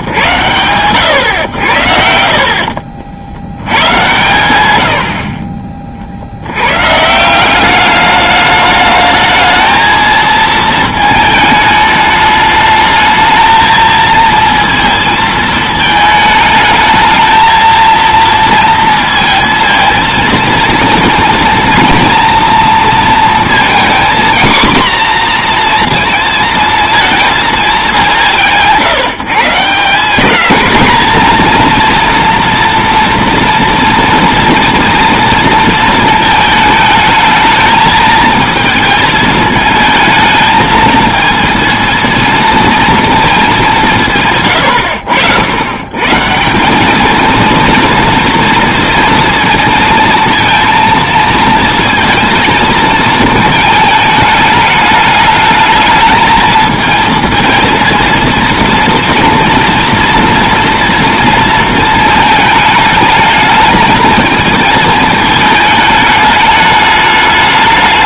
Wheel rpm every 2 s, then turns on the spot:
90, 110, 40, 180, 220, 210, 220, 220, 220, 230, 230, 230, 240, 220, 160, 230, 230, 230, 220, 220, 230, 210, 90, 230, 230, 230, 220, 220, 230, 230, 230, 220, 220, 210.
none